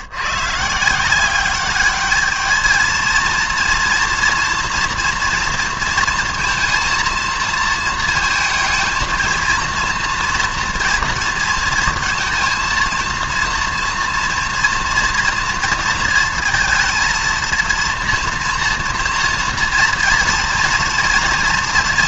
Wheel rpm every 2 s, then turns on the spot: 170, 230, 230, 230, 230, 230, 230, 230, 230, 230, 240.
none